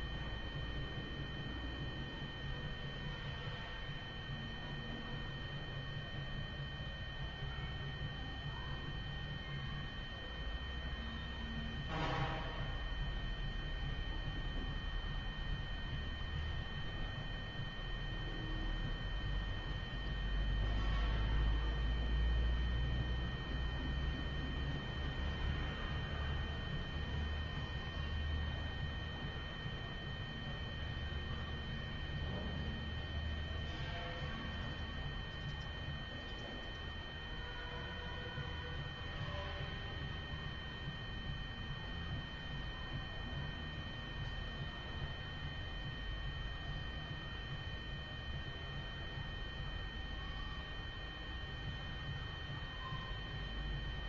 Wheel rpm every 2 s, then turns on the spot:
0, 0, 0, 0, 0, 0, 0, 0, 0, 0, 0, 0, 0, 0, 0, 0, 0, 0, 0, 0, 0, 0, 0, 0, 0, 0, 0.
none